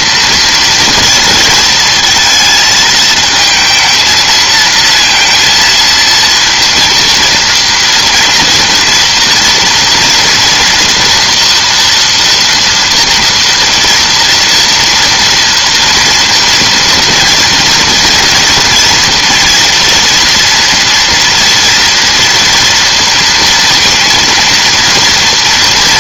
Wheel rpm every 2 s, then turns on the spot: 230, 220, 230, 230, 230, 230, 230, 230, 230, 230, 240, 230, 230.
none